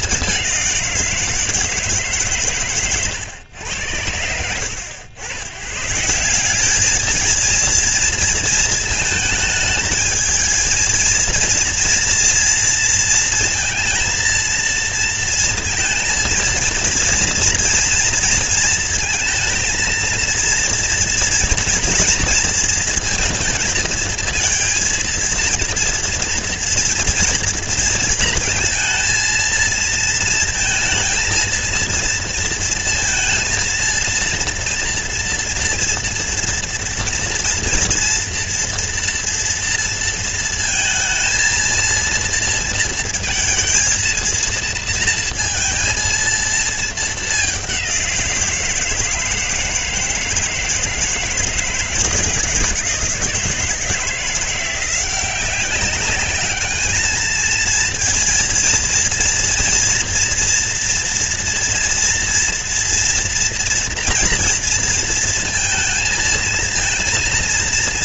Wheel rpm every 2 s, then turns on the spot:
210, 150, 90, 160, 230, 220, 230, 230, 230, 230, 230, 230, 230, 230, 230, 230, 230, 230, 230, 230, 230, 230, 230, 230, 180, 160, 160, 170, 200, 230, 230, 230, 230, 230.
none